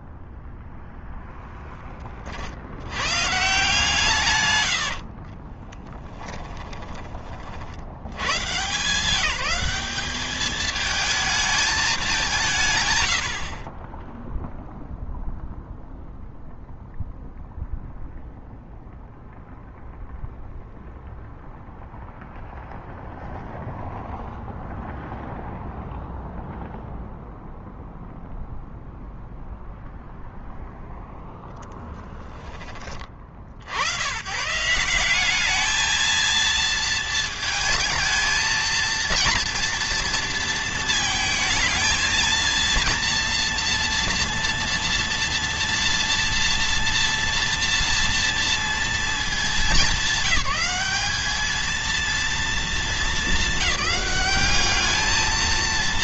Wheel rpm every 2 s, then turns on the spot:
10, 70, 100, 10, 120, 210, 160, 0, 0, 0, 0, 0, 0, 0, 0, 0, 20, 140, 230, 230, 230, 230, 230, 230, 230, 200, 220, 210.
4-8